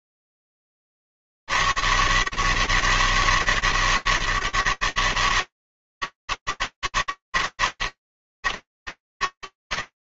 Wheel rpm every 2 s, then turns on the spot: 90, 160, 140, 160, 120.
none